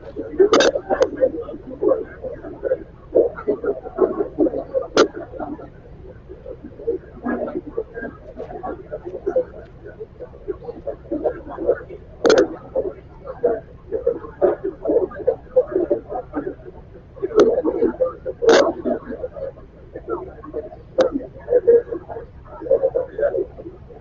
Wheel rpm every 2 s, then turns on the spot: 0, 0, 0, 0, 0, 0, 0, 0, 0, 0, 0, 0.
none